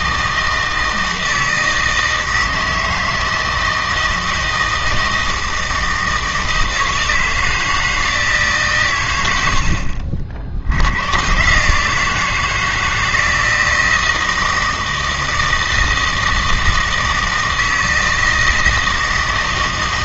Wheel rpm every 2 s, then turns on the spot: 160, 160, 160, 160, 130, 80, 160, 160, 160, 160.
none